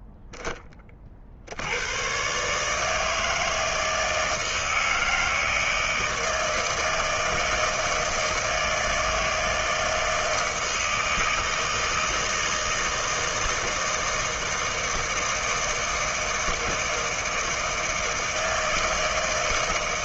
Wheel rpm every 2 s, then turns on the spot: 10, 140, 160, 160, 160, 160, 160, 160, 160, 160.
none